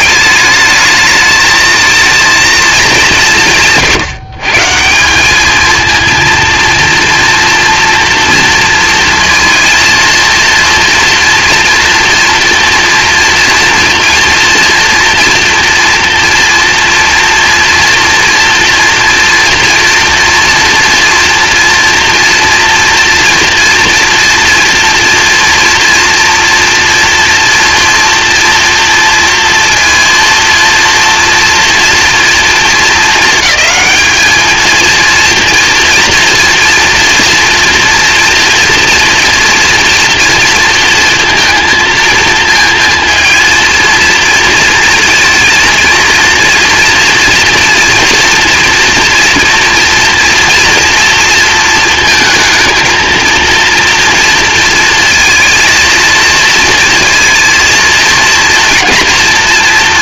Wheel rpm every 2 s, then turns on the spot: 220, 220, 150, 230, 230, 230, 230, 240, 230, 230, 230, 230, 230, 240, 240, 230, 220, 220, 230, 230, 230, 230, 230, 230, 230, 230, 230, 220, 230, 230.
none